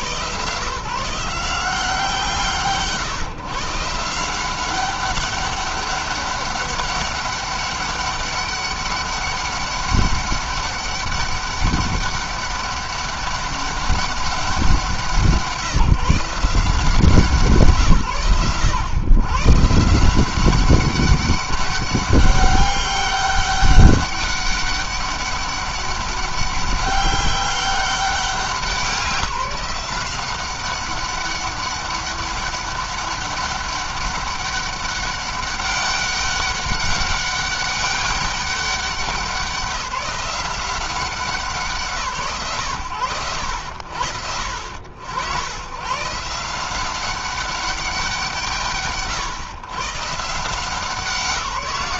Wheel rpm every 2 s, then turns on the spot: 160, 140, 190, 200, 200, 200, 200, 170, 160, 130, 190, 200, 200, 200, 190, 190, 200, 200, 200, 190, 190, 100, 90, 170, 140, 180.
none